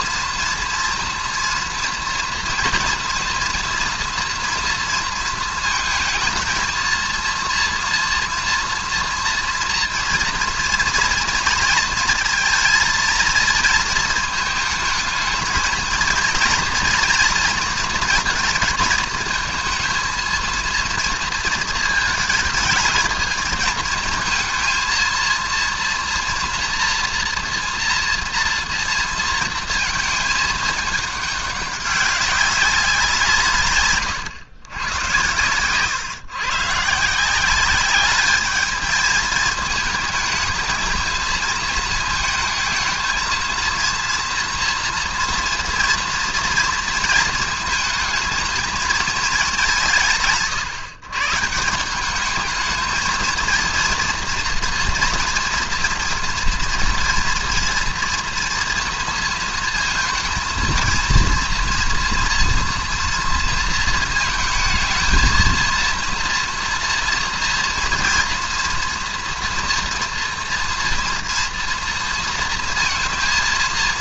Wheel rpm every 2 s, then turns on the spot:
230, 230, 230, 230, 240, 230, 230, 220, 240, 230, 230, 220, 220, 240, 230, 210, 190, 110, 130, 220, 220, 220, 230, 230, 220, 140, 220, 230, 230, 230, 230, 230, 220, 240, 230, 230, 230.
none